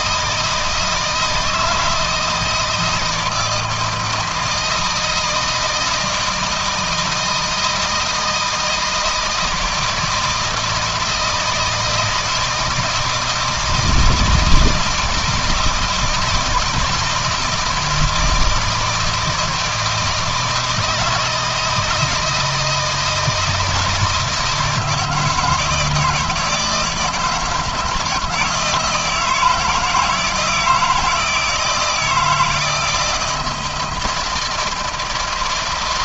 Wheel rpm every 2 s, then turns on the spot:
160, 160, 160, 160, 160, 160, 160, 160, 160, 160, 160, 160, 160, 170, 160, 160, 160, 160.
none